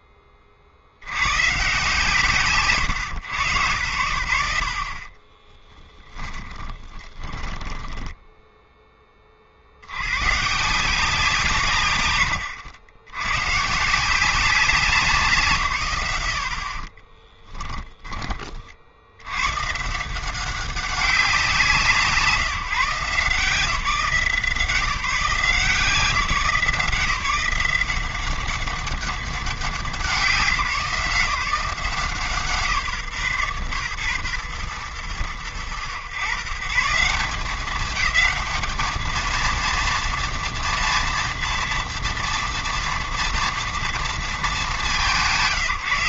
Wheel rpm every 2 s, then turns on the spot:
40, 110, 40, 20, 10, 160, 100, 180, 50, 60, 190, 150, 170, 170, 200, 170, 130, 110, 160, 220, 240, 230, 200.
6-8 16-18